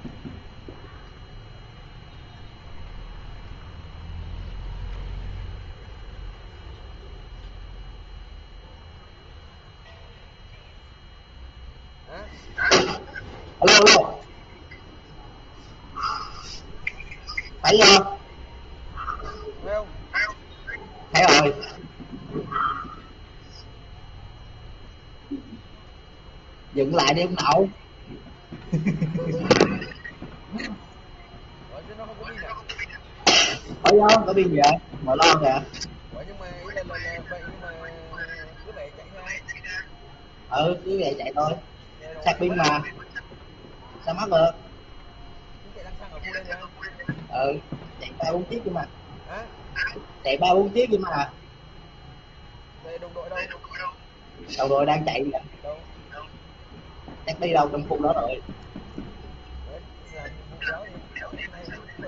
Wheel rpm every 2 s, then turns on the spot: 0, 0, 0, 0, 0, 0, 0, 0, 0, 0, 0, 0, 0, 0, 0, 0, 0, 0, 0, 0, 0, 0, 0, 0, 0, 0, 0, 0, 0, 0, 0.
none